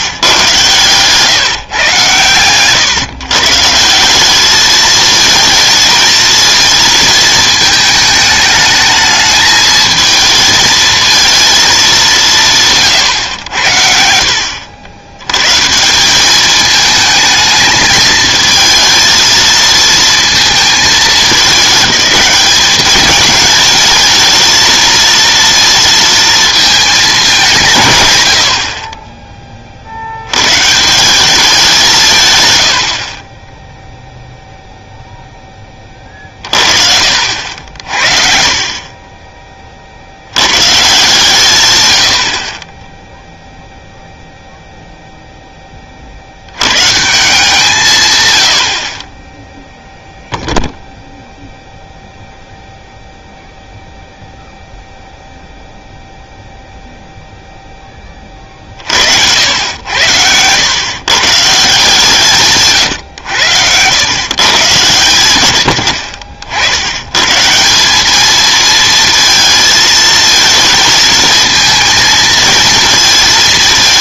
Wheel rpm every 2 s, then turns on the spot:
130, 120, 210, 230, 220, 220, 160, 80, 220, 220, 220, 200, 230, 220, 50, 130, 110, 0, 40, 40, 120, 30, 0, 90, 90, 0, 0, 0, 0, 40, 120, 140, 130, 80, 220, 220, 230.
0-2